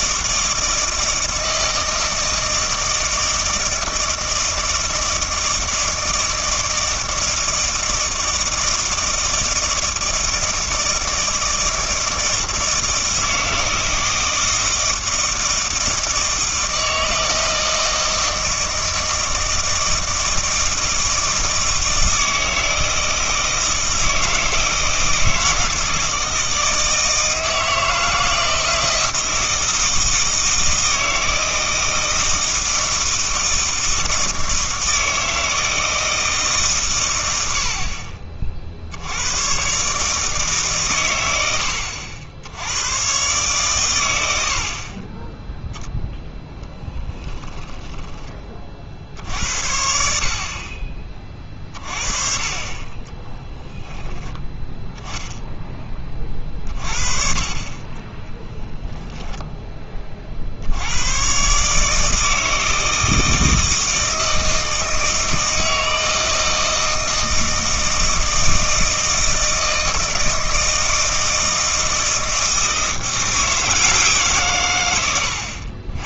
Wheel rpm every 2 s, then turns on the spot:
160, 160, 160, 160, 160, 160, 160, 160, 160, 160, 160, 160, 160, 160, 160, 160, 160, 160, 150, 50, 140, 90, 60, 10, 40, 50, 40, 10, 40, 10, 60, 160, 160, 160, 160, 160, 160, 130.
46-48